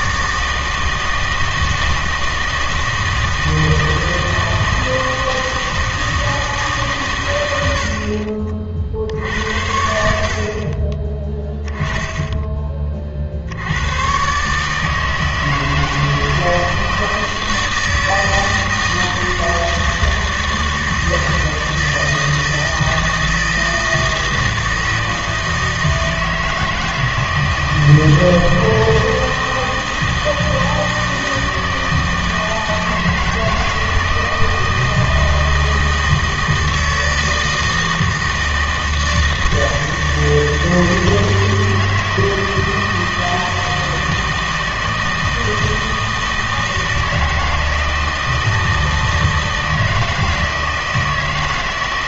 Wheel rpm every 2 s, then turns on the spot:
160, 160, 160, 150, 60, 40, 20, 150, 160, 160, 160, 160, 160, 160, 160, 160, 160, 160, 160, 160, 160, 160, 160, 160, 160, 160.
none